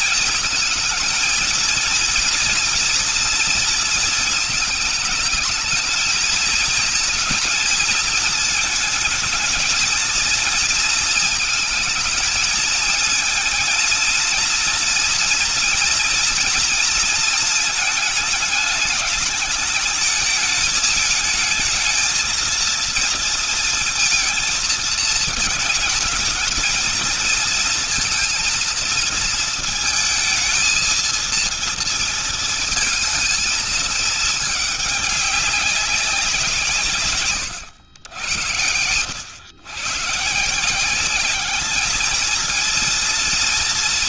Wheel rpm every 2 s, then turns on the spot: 220, 230, 220, 220, 220, 220, 230, 230, 230, 210, 220, 230, 220, 220, 230, 230, 230, 210, 190, 100, 160, 230.
none